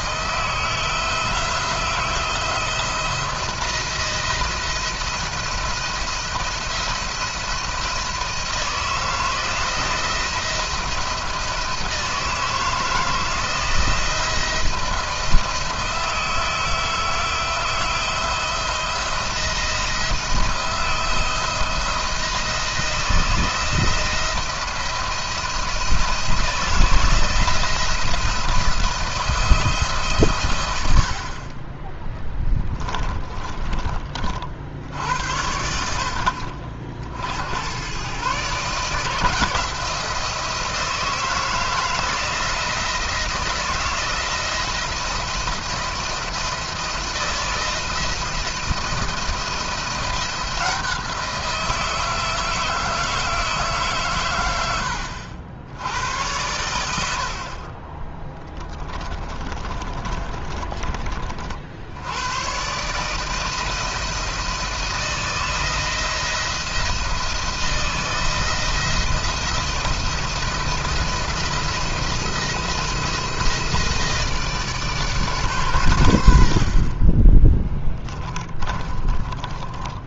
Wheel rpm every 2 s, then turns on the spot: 160, 170, 170, 170, 170, 170, 160, 170, 160, 170, 170, 170, 170, 160, 170, 100, 20, 70, 60, 140, 160, 170, 170, 170, 170, 170, 160, 90, 100, 10, 30, 130, 160, 170, 170, 170, 170, 150, 40, 20.
32-34 58-60